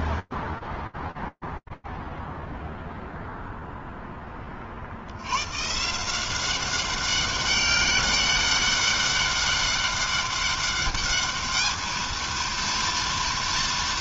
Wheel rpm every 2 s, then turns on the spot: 0, 0, 110, 200, 200, 220, 230.
none